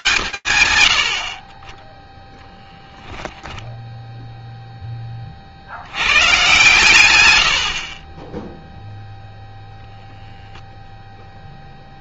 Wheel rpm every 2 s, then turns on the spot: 40, 10, 70, 60, 0, 20.
2-4